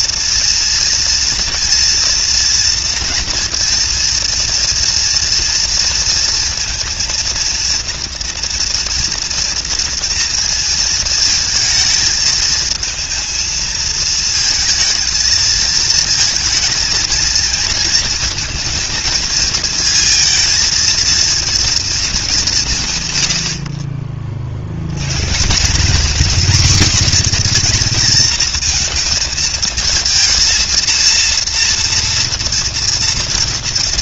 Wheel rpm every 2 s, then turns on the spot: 230, 230, 230, 230, 230, 230, 220, 220, 220, 230, 230, 150, 110, 250, 230, 230, 230.
none